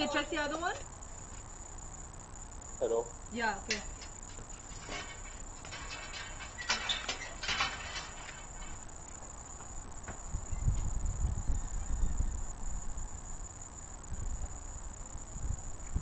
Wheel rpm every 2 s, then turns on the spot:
0, 0, 0, 0, 0, 0, 0, 0.
none